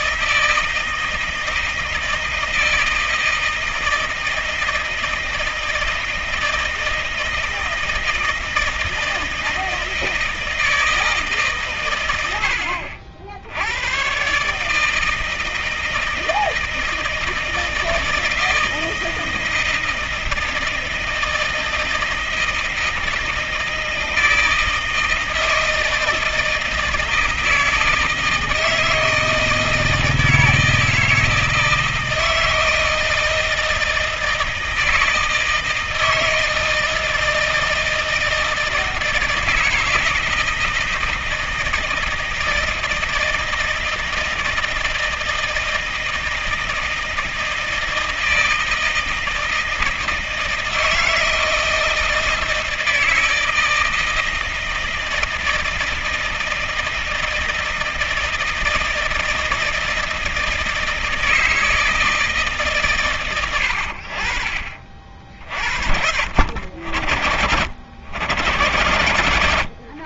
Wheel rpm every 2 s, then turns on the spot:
160, 160, 160, 160, 160, 160, 80, 140, 160, 160, 160, 160, 160, 160, 160, 160, 160, 160, 160, 160, 160, 160, 160, 160, 160, 160, 160, 160, 160, 160, 160, 150, 50, 70, 90.
none